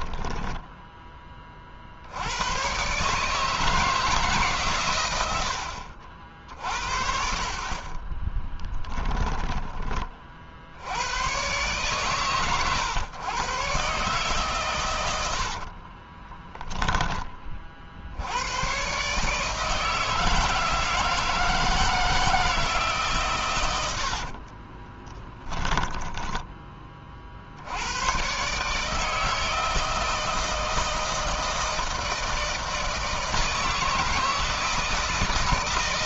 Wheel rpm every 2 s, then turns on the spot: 20, 140, 130, 60, 10, 90, 120, 110, 10, 130, 160, 150, 10, 30, 150, 160, 160, 160.
4-6 8-10 24-26